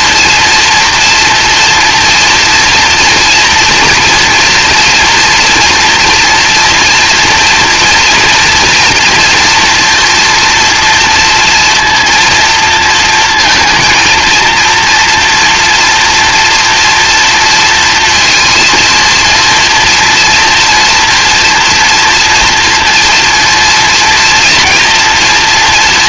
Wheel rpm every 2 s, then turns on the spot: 230, 230, 230, 230, 230, 230, 230, 230, 240, 230, 230, 230, 230.
none